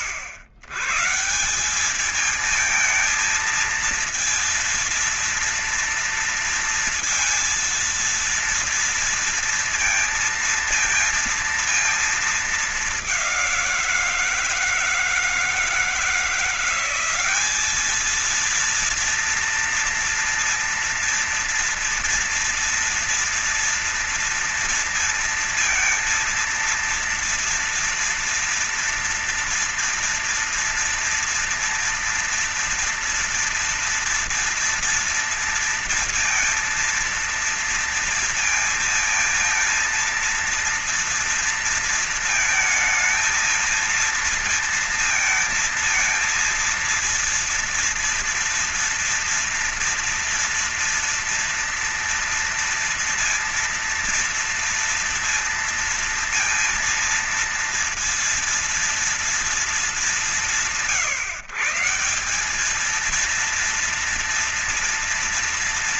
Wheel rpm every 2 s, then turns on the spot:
110, 220, 230, 230, 230, 230, 220, 170, 180, 230, 230, 230, 230, 230, 230, 230, 230, 230, 230, 230, 230, 220, 230, 230, 230, 230, 230, 230, 230, 230, 140, 200, 230.
none